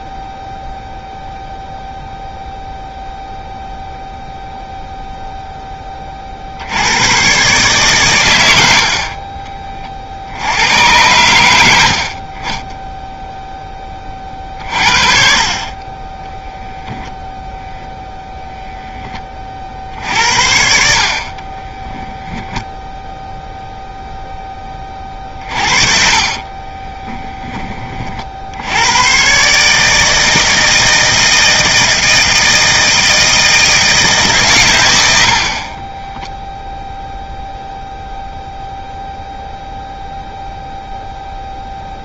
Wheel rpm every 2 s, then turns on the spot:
0, 0, 0, 90, 60, 100, 20, 40, 0, 10, 60, 0, 30, 20, 100, 160, 160, 110, 0, 0, 0.
12-14 26-28